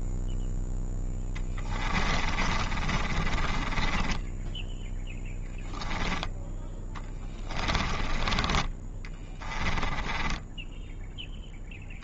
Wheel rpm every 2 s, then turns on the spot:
0, 30, 10, 10, 20, 10.
2-4